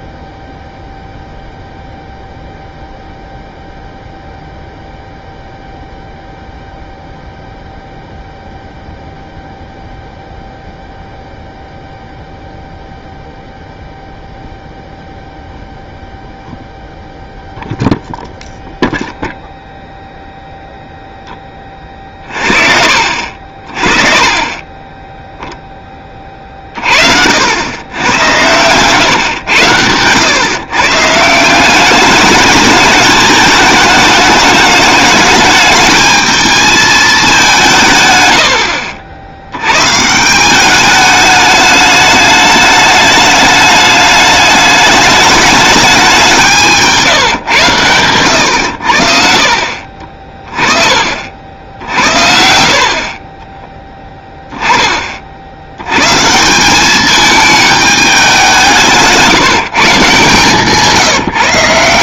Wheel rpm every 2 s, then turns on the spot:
0, 0, 0, 0, 0, 0, 0, 0, 0, 0, 0, 50, 20, 40, 130, 130, 210, 210, 220, 70, 200, 210, 210, 160, 90, 20, 50, 20, 190, 180, 160.
46-48